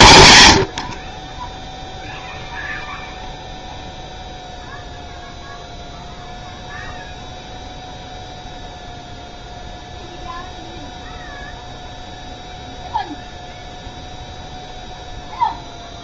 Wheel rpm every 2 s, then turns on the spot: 110, 0, 0, 0, 0, 0, 0, 0.
none